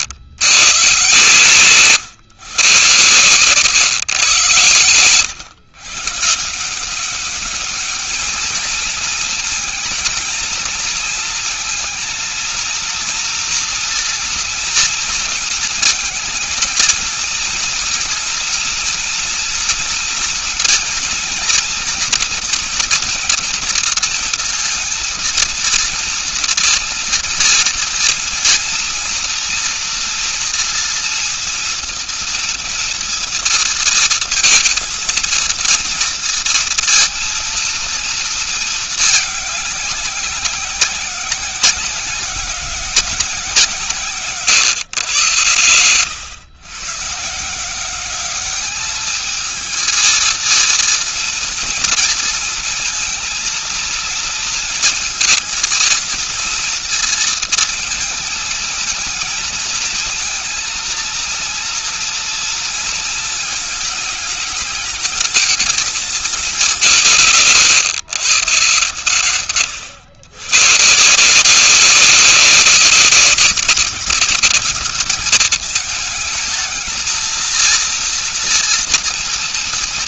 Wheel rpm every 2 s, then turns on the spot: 130, 130, 110, 190, 220, 230, 230, 230, 230, 230, 240, 230, 230, 230, 230, 230, 230, 220, 230, 210, 190, 180, 120, 130, 210, 230, 230, 230, 230, 220, 230, 230, 220, 180, 140, 150, 200, 200, 220, 230.
none